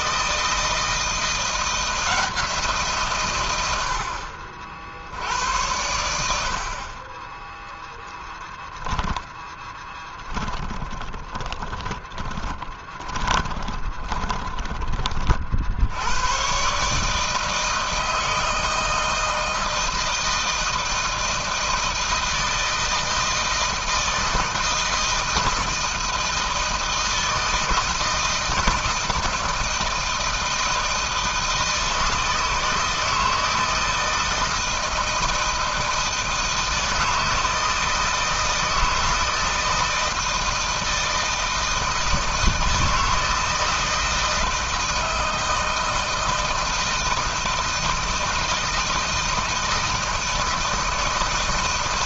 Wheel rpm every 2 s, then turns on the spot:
160, 170, 60, 60, 10, 20, 20, 20, 110, 160, 160, 160, 160, 160, 160, 160, 160, 160, 160, 160, 160, 160, 160, 160, 160, 160.
10-16